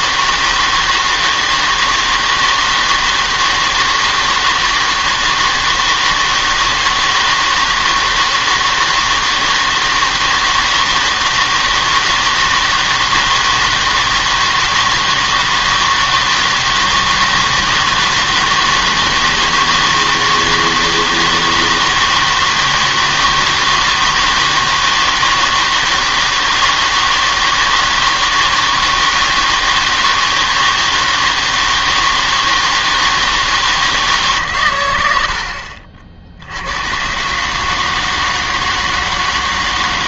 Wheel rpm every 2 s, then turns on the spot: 160, 160, 160, 160, 160, 160, 160, 160, 160, 160, 160, 160, 160, 160, 160, 160, 160, 120, 90, 160.
none